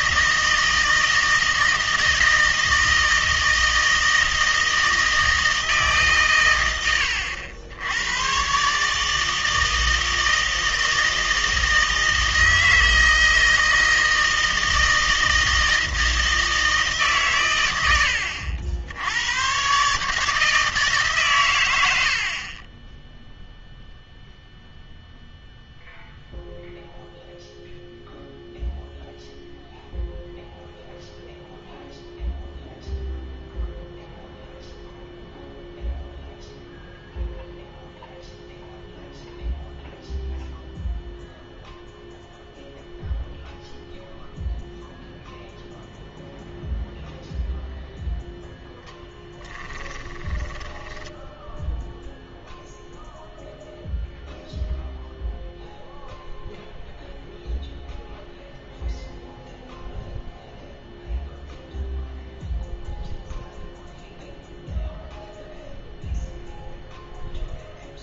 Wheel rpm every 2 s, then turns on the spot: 160, 160, 160, 90, 150, 160, 160, 160, 150, 80, 150, 10, 0, 0, 0, 0, 0, 0, 0, 0, 0, 0, 0, 0, 10, 10, 0, 0, 0, 0, 0, 0, 0, 0.
50-52